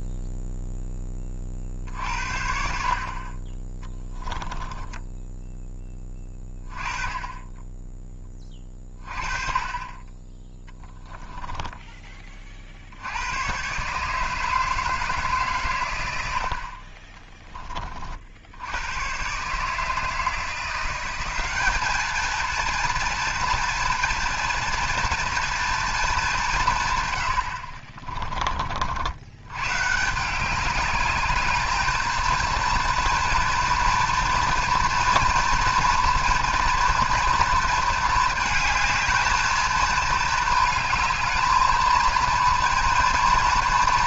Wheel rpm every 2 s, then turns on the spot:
0, 60, 10, 20, 30, 10, 50, 160, 60, 80, 170, 230, 230, 170, 50, 200, 230, 230, 230, 220, 220, 230.
4-6